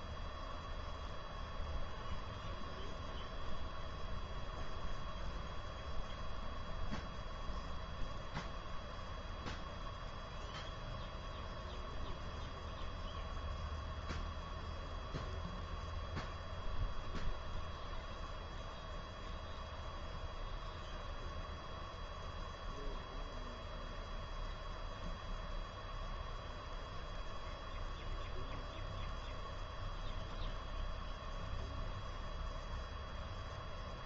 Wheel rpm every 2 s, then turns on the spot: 0, 0, 0, 0, 0, 0, 0, 0, 0, 0, 0, 0, 0, 0, 0, 0, 0.
none